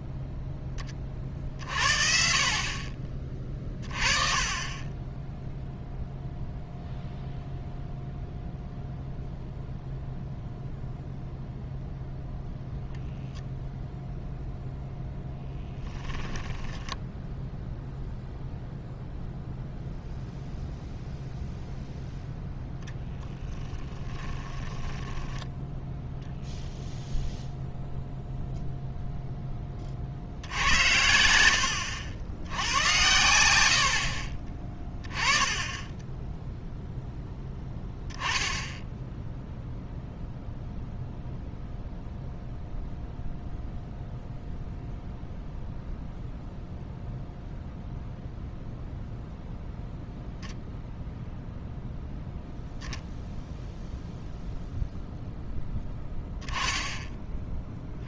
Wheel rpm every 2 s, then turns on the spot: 10, 40, 30, 0, 0, 0, 0, 0, 10, 0, 0, 0, 10, 10, 0, 80, 80, 20, 0, 10, 0, 0, 0, 0, 0, 0, 0, 0, 10.
16-18 24-26 56-58